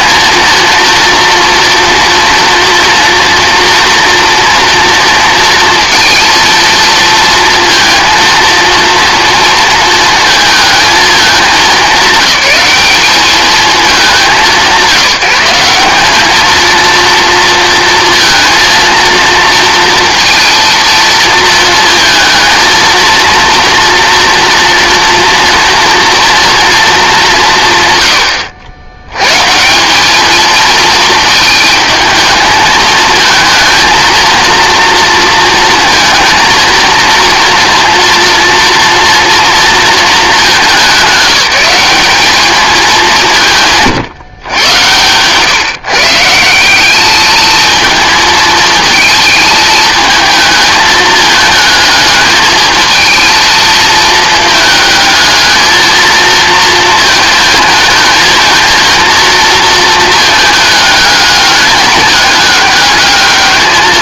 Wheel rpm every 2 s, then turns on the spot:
230, 230, 230, 230, 230, 220, 200, 170, 220, 230, 230, 220, 230, 230, 90, 220, 220, 230, 230, 230, 190, 210, 120, 190, 220, 220, 220, 220, 230, 220, 220, 210.
none